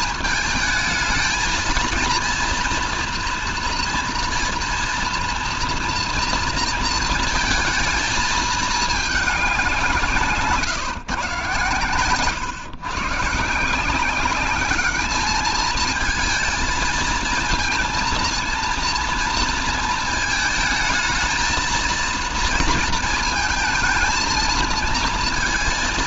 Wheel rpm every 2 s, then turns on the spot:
220, 230, 230, 230, 220, 140, 140, 200, 220, 230, 220, 230, 220.
none